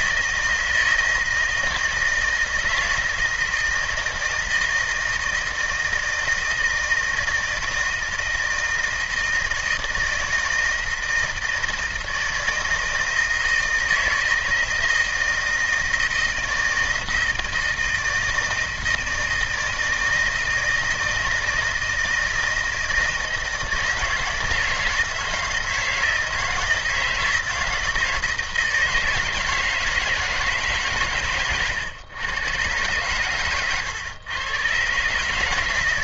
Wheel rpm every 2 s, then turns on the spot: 160, 160, 160, 160, 160, 160, 160, 160, 160, 160, 160, 160, 160, 160, 160, 140, 110, 130.
none